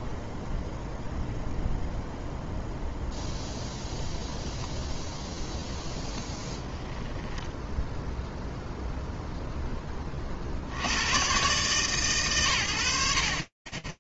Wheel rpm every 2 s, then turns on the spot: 0, 0, 10, 10, 0, 120, 70.
none